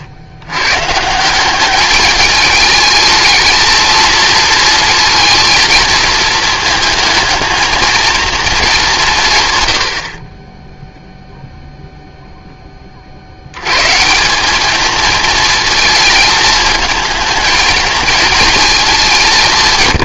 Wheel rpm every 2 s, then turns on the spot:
140, 220, 230, 220, 200, 0, 30, 220, 220, 210.
none